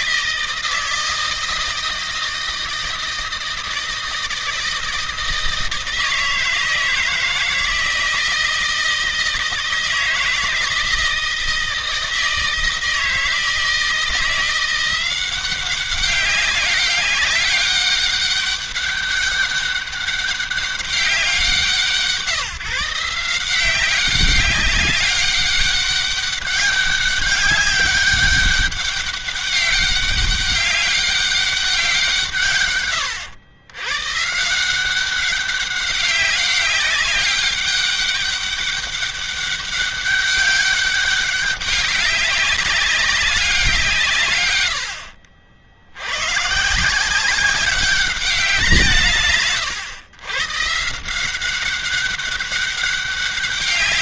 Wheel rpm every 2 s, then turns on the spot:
160, 160, 160, 160, 160, 160, 160, 180, 190, 200, 190, 160, 190, 200, 200, 200, 120, 180, 200, 200, 200, 200, 80, 160, 160, 150, 200.
none